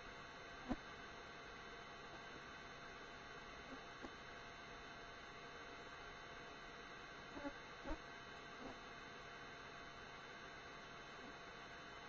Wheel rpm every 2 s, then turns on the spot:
0, 0, 0, 0, 0, 0.
none